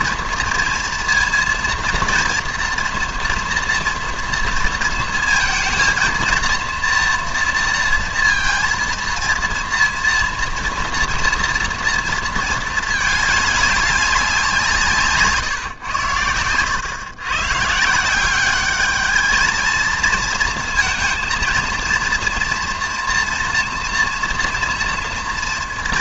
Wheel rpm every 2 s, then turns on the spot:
230, 230, 230, 230, 230, 230, 220, 170, 110, 210, 230, 230, 230.
none